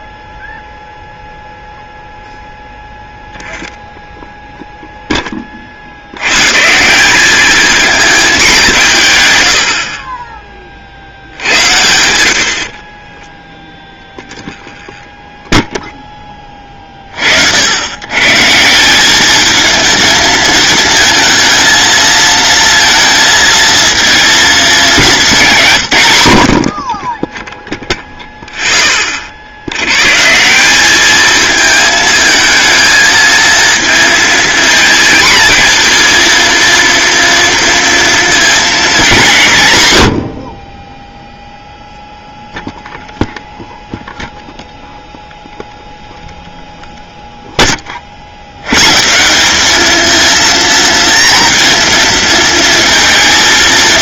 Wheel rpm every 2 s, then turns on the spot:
0, 0, 0, 150, 170, 40, 50, 10, 30, 180, 230, 230, 220, 50, 10, 190, 220, 230, 230, 230, 20, 0, 0, 0, 120, 230, 230.
12-16